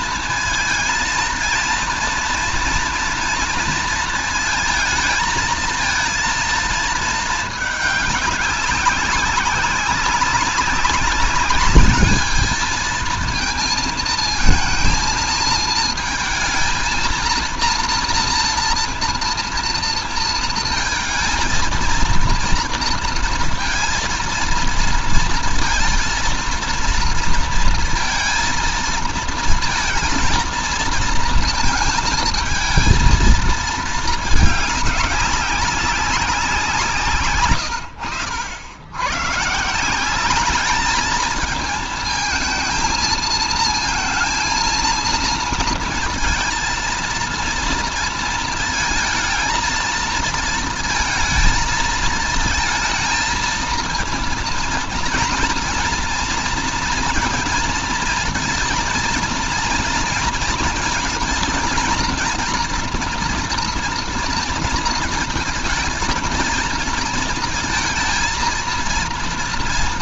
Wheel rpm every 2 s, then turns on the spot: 230, 230, 220, 230, 200, 190, 220, 230, 230, 230, 220, 230, 230, 230, 230, 230, 230, 200, 170, 80, 210, 220, 230, 230, 220, 230, 220, 230, 230, 230, 220, 230, 230, 230, 230.
none